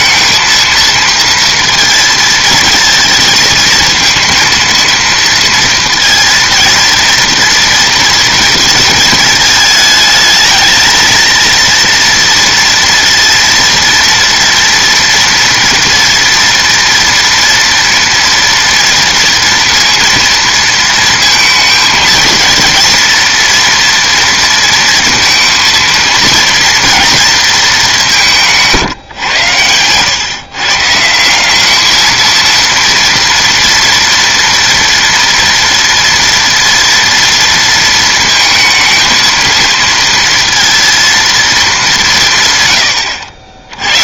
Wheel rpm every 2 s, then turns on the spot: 230, 230, 230, 230, 220, 220, 230, 230, 240, 230, 230, 230, 230, 230, 150, 150, 230, 230, 230, 220, 230, 110.
none